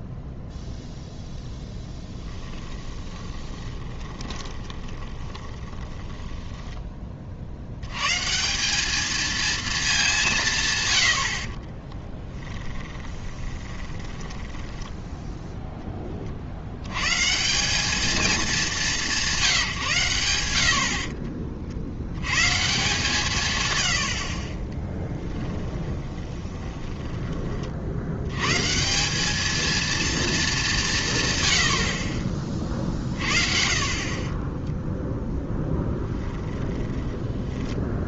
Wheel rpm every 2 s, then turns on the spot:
0, 20, 20, 10, 190, 140, 20, 10, 70, 210, 90, 150, 30, 20, 140, 200, 30, 20, 20.
2-8 12-16 26-28 34-36